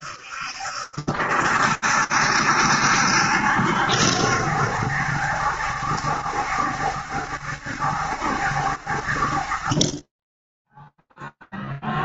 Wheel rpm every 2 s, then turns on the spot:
60, 60, 70, 70, 60, 10.
none